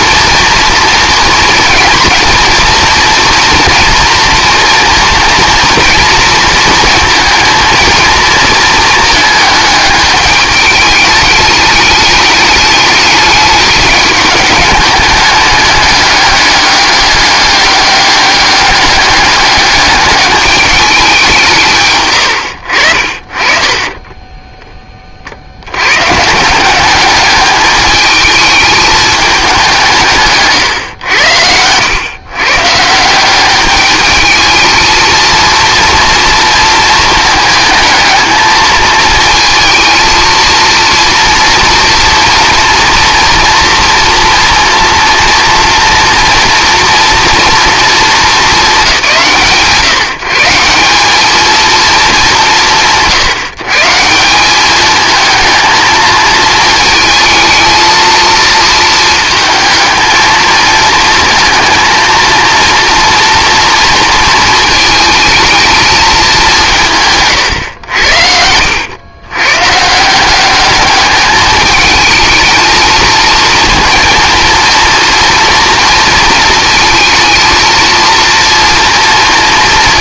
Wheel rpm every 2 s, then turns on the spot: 230, 230, 230, 230, 220, 210, 210, 210, 200, 200, 200, 60, 20, 190, 220, 130, 150, 220, 220, 220, 230, 230, 230, 230, 190, 170, 170, 210, 220, 220, 220, 230, 230, 180, 80, 200, 220, 230, 230, 230.
none